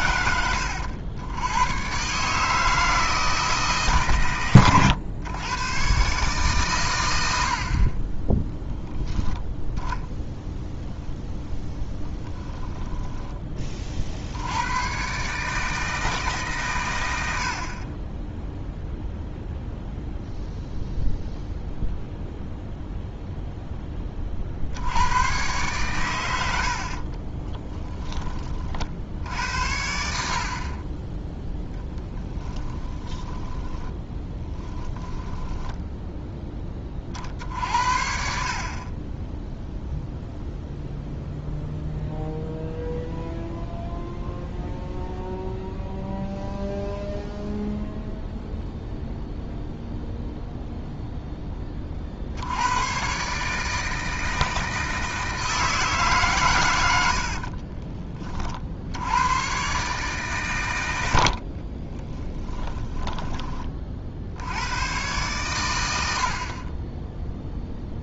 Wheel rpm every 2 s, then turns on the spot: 90, 160, 110, 110, 0, 0, 10, 130, 100, 0, 0, 0, 90, 40, 30, 60, 10, 10, 10, 60, 0, 0, 0, 0, 0, 0, 70, 160, 140, 40, 130, 10, 70, 50.
12-14 26-28 32-36 62-64